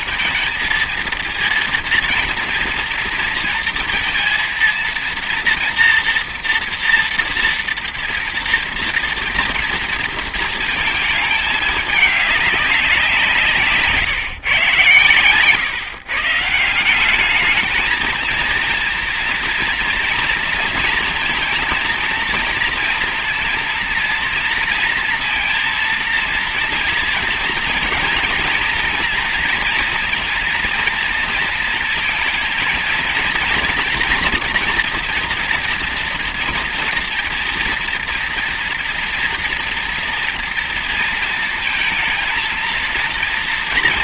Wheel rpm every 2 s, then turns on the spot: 230, 230, 230, 230, 230, 220, 180, 120, 180, 230, 230, 230, 230, 230, 230, 230, 220, 230, 230, 230, 230, 230.
none